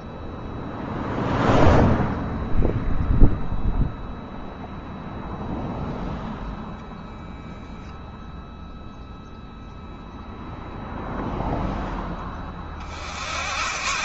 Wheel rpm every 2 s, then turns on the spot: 0, 0, 0, 0, 0, 0, 60.
none